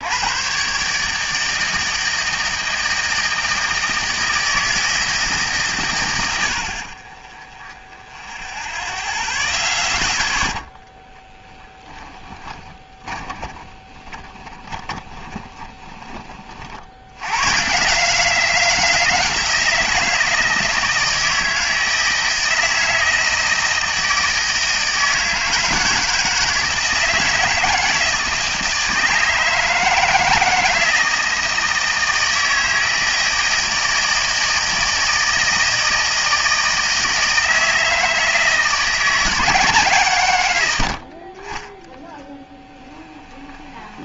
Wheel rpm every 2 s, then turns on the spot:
140, 160, 160, 40, 0, 10, 20, 20, 70, 180, 160, 160, 160, 160, 160, 160, 160, 160, 160, 160, 80, 10.
12-16 42-44